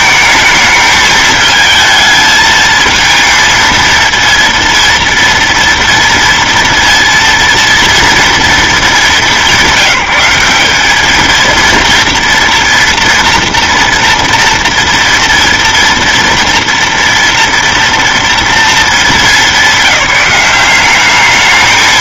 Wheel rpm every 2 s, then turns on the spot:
220, 220, 230, 230, 220, 190, 230, 230, 230, 230, 190.
none